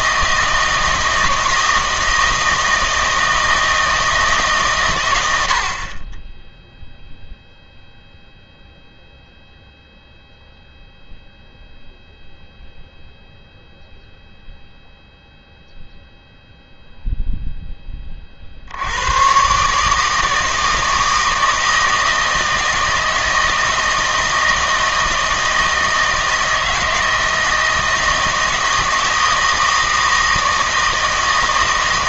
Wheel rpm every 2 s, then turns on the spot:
160, 160, 120, 0, 0, 0, 0, 0, 0, 70, 160, 160, 160, 160, 160, 160.
none